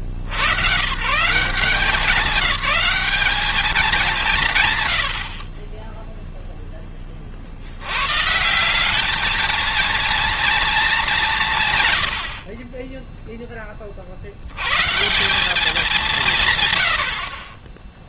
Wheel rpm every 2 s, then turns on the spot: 80, 180, 160, 0, 140, 230, 40, 90, 130.
none